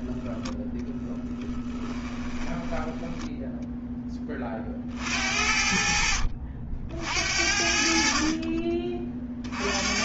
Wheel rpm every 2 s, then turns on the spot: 10, 10, 60, 60, 30.
2-4